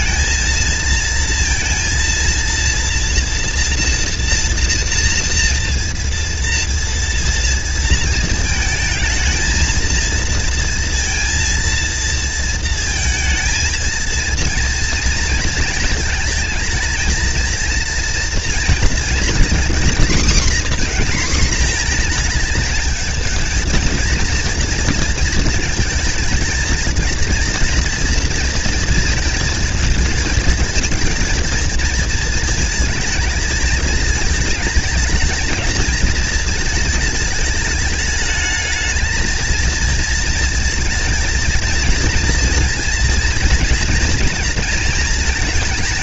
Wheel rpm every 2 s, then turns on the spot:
230, 230, 230, 230, 230, 230, 230, 230, 230, 230, 240, 230, 230, 230, 230, 230, 220, 220, 220, 220, 230, 230, 230.
none